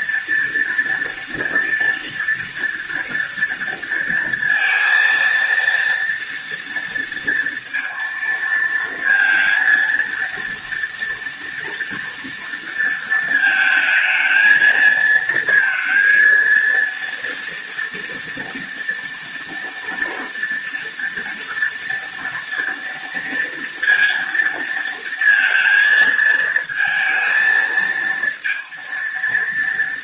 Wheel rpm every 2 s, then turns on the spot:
230, 230, 230, 230, 230, 230, 230, 220, 230, 230, 230, 230, 230, 220, 230.
none